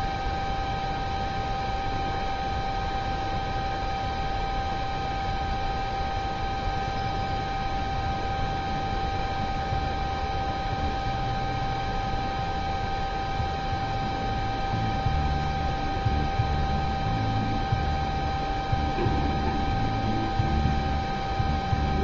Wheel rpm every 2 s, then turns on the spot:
0, 0, 0, 0, 0, 0, 0, 0, 0, 0, 0.
none